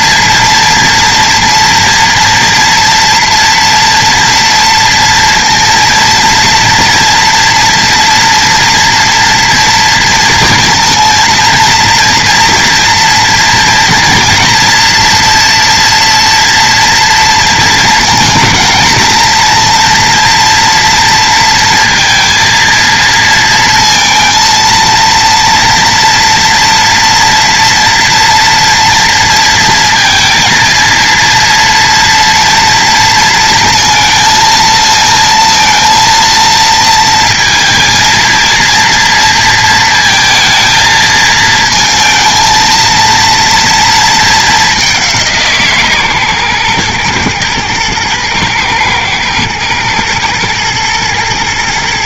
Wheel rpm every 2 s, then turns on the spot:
240, 230, 230, 240, 230, 230, 230, 230, 230, 230, 230, 230, 230, 230, 240, 230, 230, 220, 230, 230, 230, 220, 200, 120, 110, 120.
none